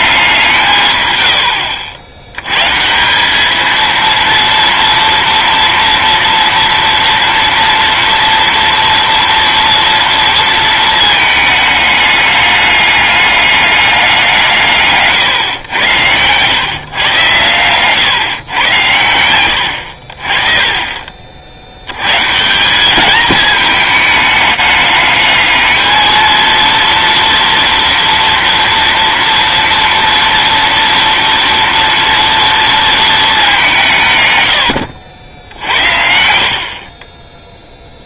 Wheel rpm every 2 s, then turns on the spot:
160, 120, 230, 230, 230, 230, 210, 170, 130, 110, 30, 170, 210, 230, 240, 230, 230, 110, 50.
none